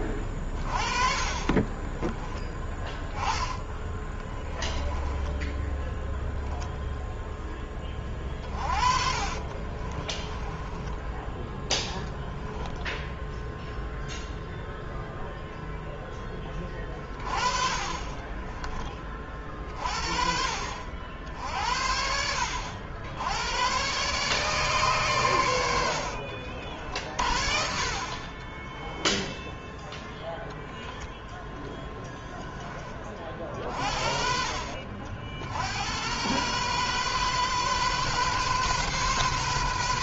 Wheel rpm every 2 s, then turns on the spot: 30, 10, 10, 0, 30, 20, 0, 0, 10, 20, 60, 70, 140, 60, 20, 10, 10, 60, 120, 130.
0-2 4-6 8-12 26-30